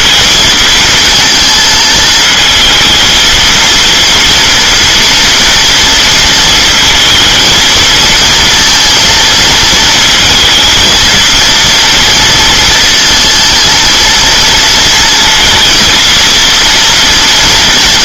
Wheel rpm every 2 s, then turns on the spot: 230, 220, 230, 230, 220, 230, 230, 230, 230.
none